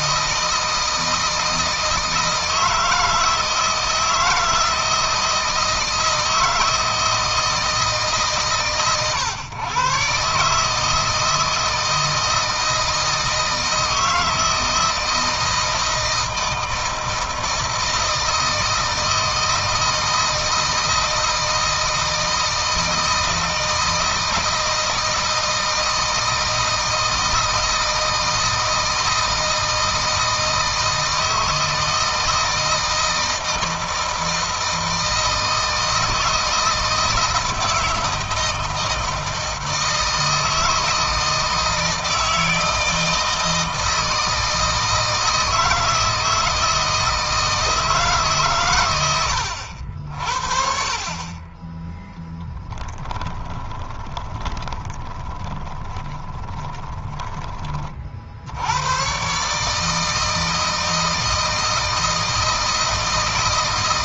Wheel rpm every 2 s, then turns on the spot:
160, 160, 160, 160, 130, 150, 160, 160, 160, 160, 160, 160, 160, 160, 160, 160, 160, 160, 160, 160, 160, 160, 160, 160, 130, 40, 10, 20, 20, 80, 160, 160.
52-58